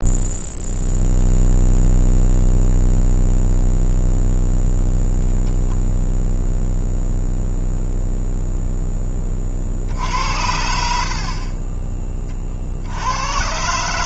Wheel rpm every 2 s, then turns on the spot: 0, 0, 0, 0, 0, 70, 60.
none